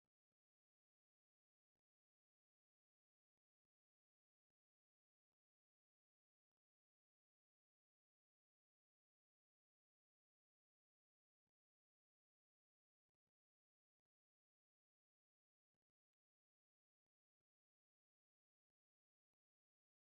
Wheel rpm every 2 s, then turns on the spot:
0, 0, 0, 0, 0, 0, 0, 0, 0, 0.
none